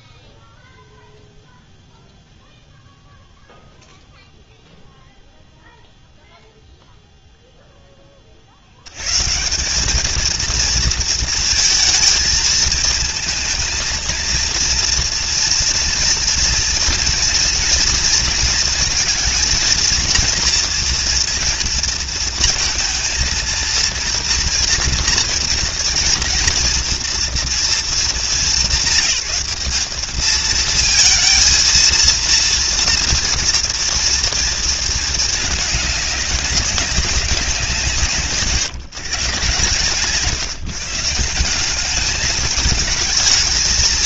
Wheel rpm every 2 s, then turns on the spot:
0, 0, 0, 0, 70, 230, 230, 230, 230, 230, 230, 230, 230, 230, 190, 220, 230, 220, 200, 140, 160, 220.
none